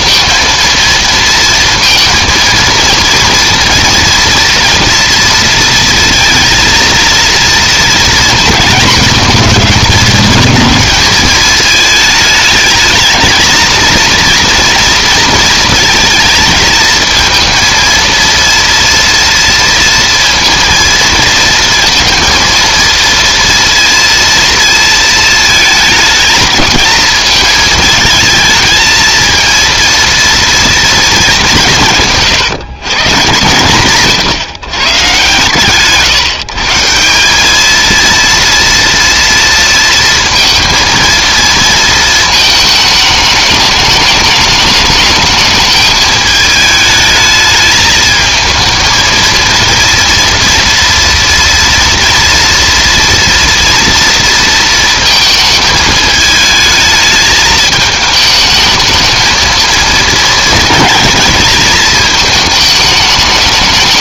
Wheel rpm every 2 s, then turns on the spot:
230, 230, 230, 230, 230, 220, 220, 230, 220, 230, 230, 230, 230, 220, 220, 230, 140, 140, 150, 230, 230, 220, 210, 210, 220, 240, 240, 230, 220, 220, 230, 220.
none